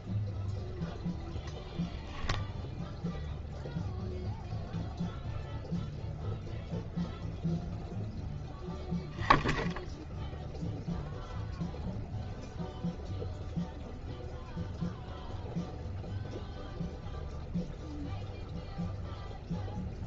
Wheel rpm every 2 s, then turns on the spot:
0, 0, 0, 0, 0, 0, 0, 0, 0, 0.
none